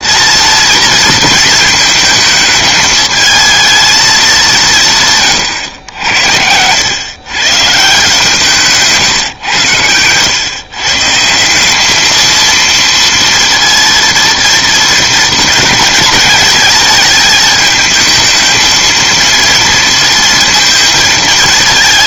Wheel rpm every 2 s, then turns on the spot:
230, 220, 180, 100, 160, 120, 230, 230, 220, 220, 230.
none